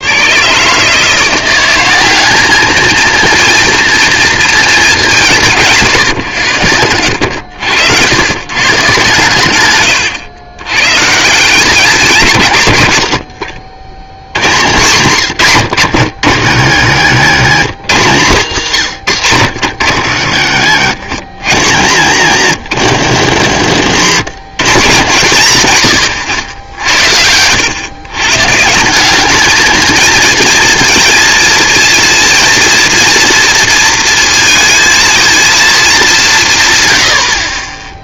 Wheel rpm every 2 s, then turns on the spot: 130, 220, 230, 100, 120, 110, 160, 80, 80, 100, 70, 90, 130, 90, 140, 230, 230, 230, 190.
26-28